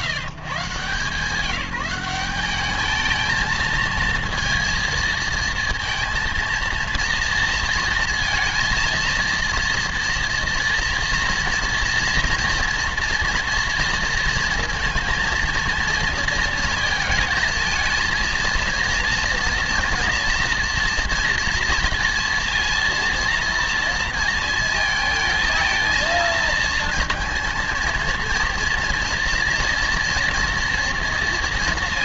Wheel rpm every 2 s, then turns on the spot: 150, 210, 230, 230, 230, 230, 230, 230, 230, 220, 230, 230, 230, 230, 230, 230.
none